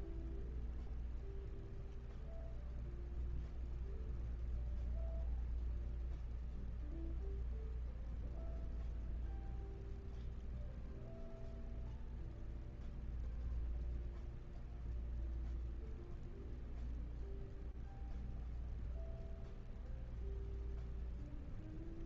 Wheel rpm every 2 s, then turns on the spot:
0, 0, 0, 0, 0, 0, 0, 0, 0, 0, 0.
none